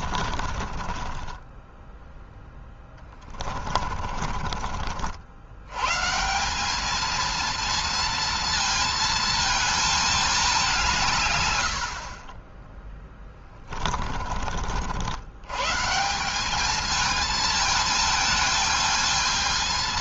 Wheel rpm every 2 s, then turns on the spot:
40, 10, 50, 200, 230, 170, 20, 60, 200, 220.
0-4 12-14